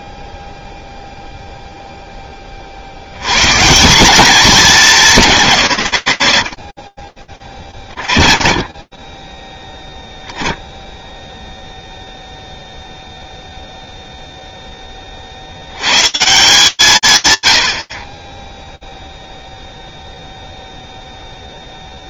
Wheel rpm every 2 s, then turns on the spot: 0, 60, 200, 50, 30, 10, 0, 50, 120, 0, 20.
6-8